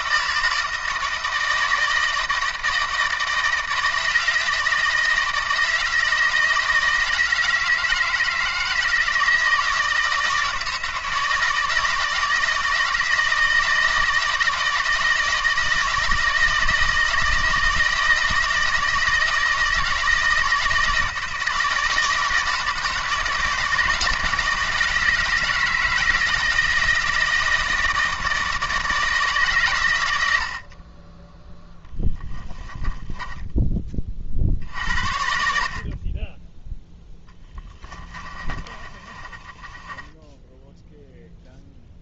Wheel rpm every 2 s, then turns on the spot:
160, 160, 160, 160, 160, 160, 160, 170, 160, 160, 160, 160, 160, 160, 160, 50, 20, 60, 0, 30, 0.
30-34 38-40